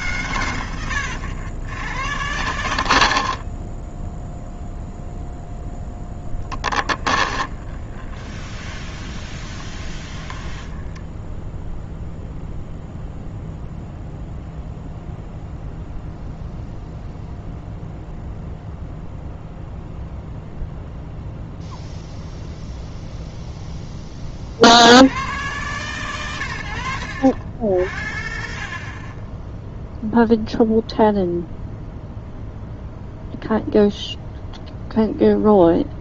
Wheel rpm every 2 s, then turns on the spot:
110, 60, 0, 20, 20, 10, 0, 0, 0, 0, 0, 0, 80, 90, 30, 0, 0, 0.
0-2 6-12 26-28